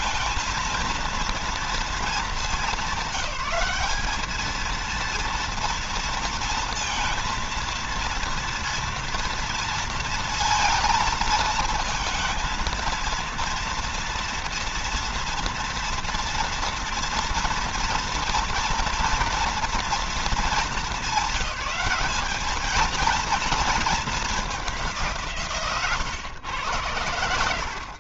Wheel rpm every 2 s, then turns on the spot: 230, 190, 230, 230, 240, 230, 230, 230, 230, 230, 210, 230, 160, 90.
none